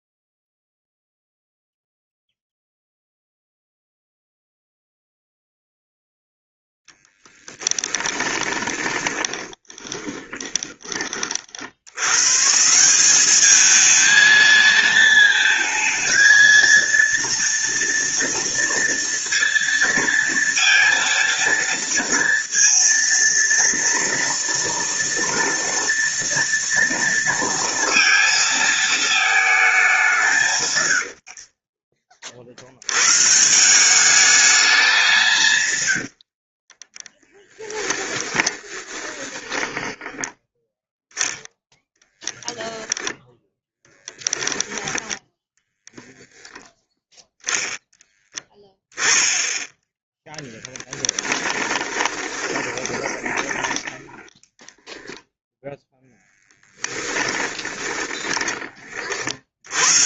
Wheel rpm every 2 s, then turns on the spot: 0, 0, 0, 10, 20, 40, 190, 220, 230, 230, 230, 230, 230, 230, 220, 90, 130, 180, 10, 10, 0, 0, 10, 0, 10, 20, 20, 0, 10, 50.
6-10 36-40 50-54 56-58